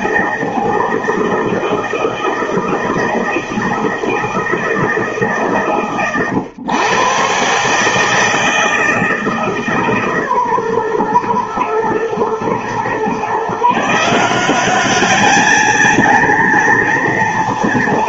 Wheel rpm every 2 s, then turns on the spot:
160, 160, 140, 130, 160, 120, 130, 210, 230.
none